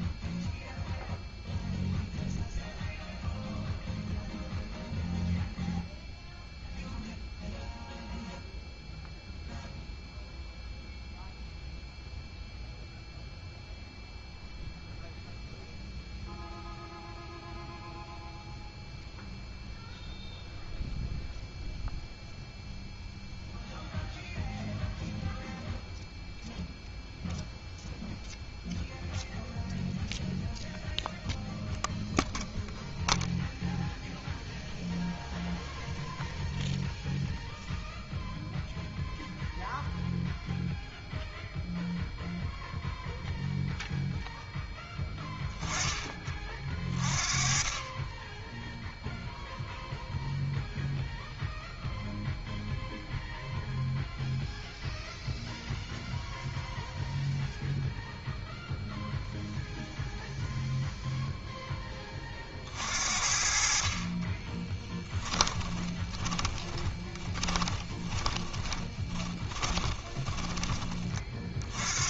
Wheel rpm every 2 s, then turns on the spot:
0, 0, 0, 0, 0, 0, 0, 0, 0, 0, 0, 0, 0, 0, 0, 0, 0, 0, 0, 0, 0, 0, 20, 40, 0, 0, 0, 0, 0, 0, 0, 50, 20, 20, 20, 20.
64-70